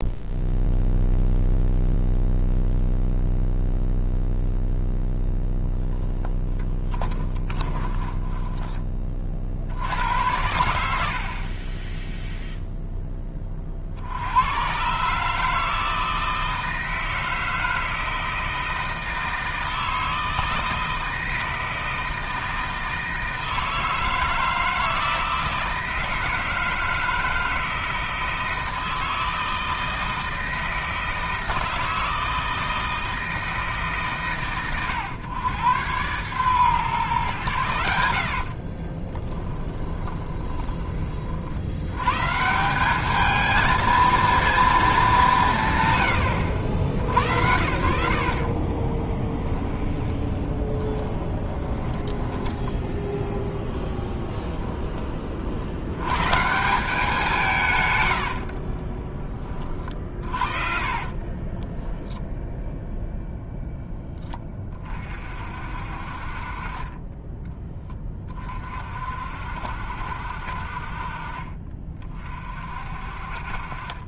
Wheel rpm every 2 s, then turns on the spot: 0, 0, 0, 10, 20, 80, 0, 120, 160, 160, 160, 160, 160, 160, 160, 160, 160, 110, 130, 40, 20, 180, 220, 90, 30, 20, 10, 30, 170, 30, 50, 0, 30, 30, 40, 50, 40.
6-8 38-40 48-54 58-62